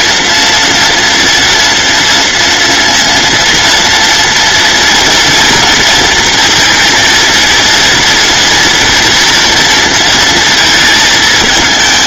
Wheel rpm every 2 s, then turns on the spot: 230, 230, 240, 230, 230, 220.
none